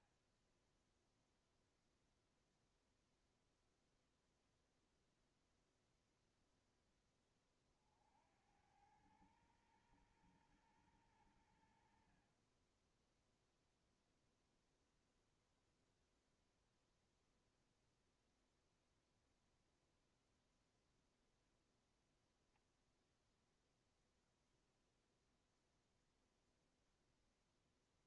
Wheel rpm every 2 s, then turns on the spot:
30, 0, 0, 0, 70, 120, 50, 0, 0, 0, 0, 0, 0, 0.
none